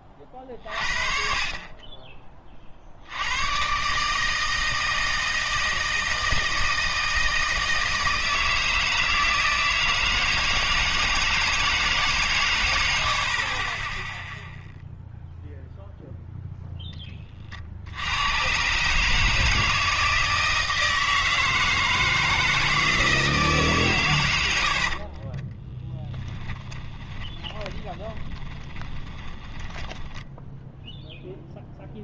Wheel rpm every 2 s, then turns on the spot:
40, 40, 160, 160, 160, 160, 100, 0, 0, 130, 160, 160, 70, 10, 20, 0.
24-30